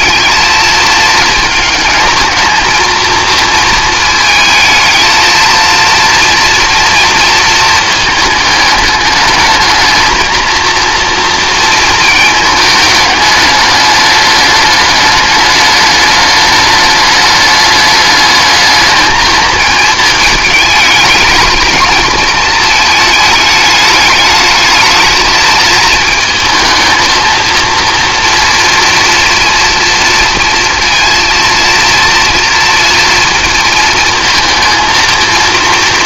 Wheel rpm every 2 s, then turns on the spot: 220, 220, 220, 230, 210, 230, 210, 210, 210, 210, 220, 220, 220, 220, 230, 230, 230, 230.
none